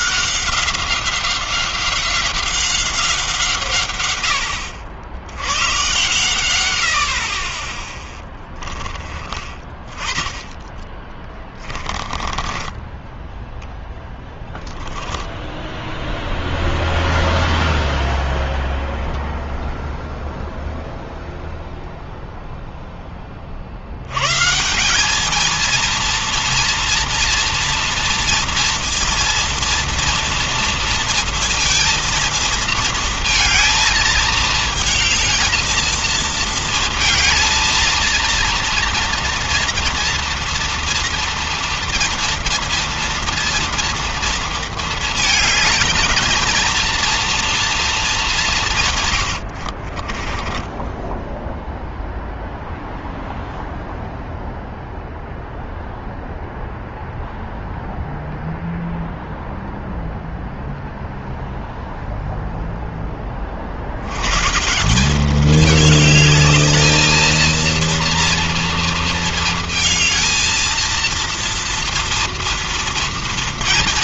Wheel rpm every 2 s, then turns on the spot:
190, 180, 90, 60, 20, 20, 10, 10, 0, 0, 0, 20, 200, 240, 230, 230, 230, 220, 230, 230, 240, 230, 220, 230, 120, 10, 0, 0, 0, 0, 0, 10, 190, 220, 230, 230, 230.
10-12 14-16 48-50